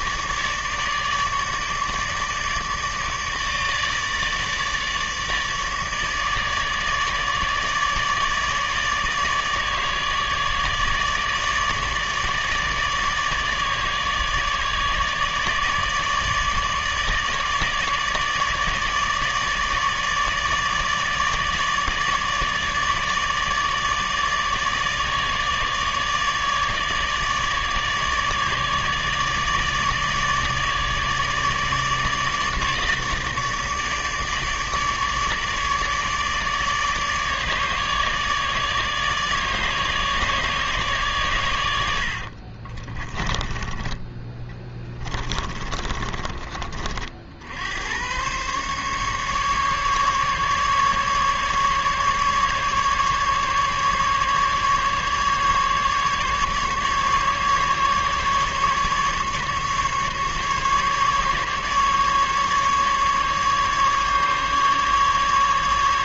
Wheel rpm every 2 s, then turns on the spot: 150, 150, 150, 150, 150, 150, 150, 150, 150, 150, 150, 150, 150, 150, 150, 150, 150, 150, 150, 150, 140, 20, 20, 40, 140, 150, 140, 150, 150, 150, 150, 150, 150.
42-46